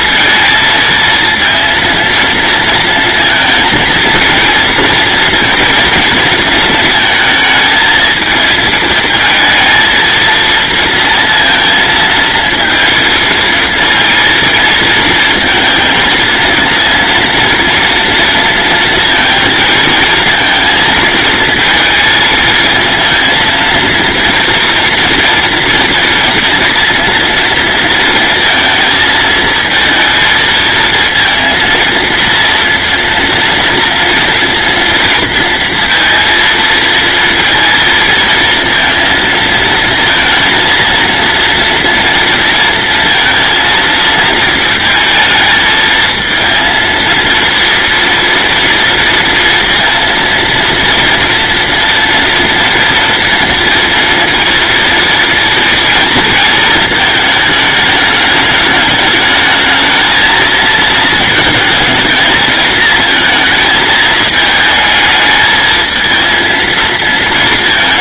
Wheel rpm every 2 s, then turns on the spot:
220, 230, 230, 220, 220, 230, 230, 230, 230, 230, 230, 230, 230, 230, 220, 230, 230, 230, 230, 230, 230, 230, 220, 230, 230, 230, 230, 230, 220, 210, 230, 220, 220, 230.
none